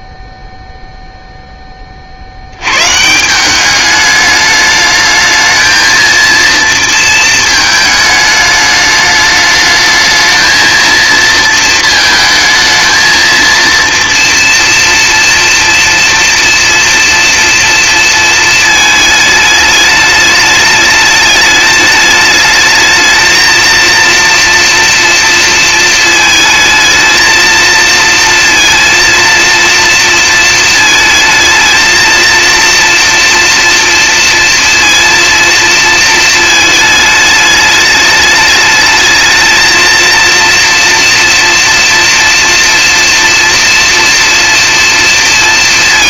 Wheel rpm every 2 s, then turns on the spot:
0, 130, 220, 230, 210, 230, 220, 230, 240, 220, 210, 220, 230, 230, 230, 220, 230, 230, 220, 220, 240, 230, 230.
none